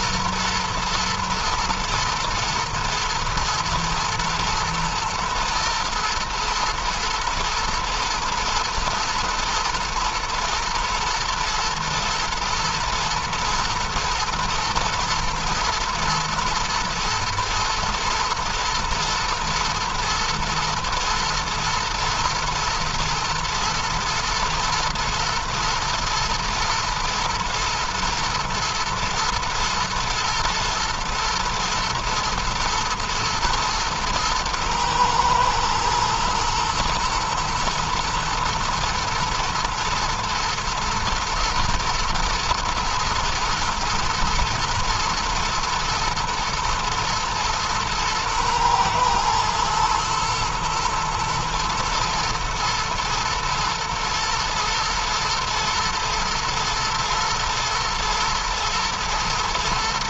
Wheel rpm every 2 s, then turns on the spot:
120, 120, 110, 120, 120, 110, 110, 110, 120, 120, 120, 110, 110, 120, 120, 110, 110, 110, 110, 110, 110, 110, 120, 110, 110, 110, 110, 120, 110, 110.
none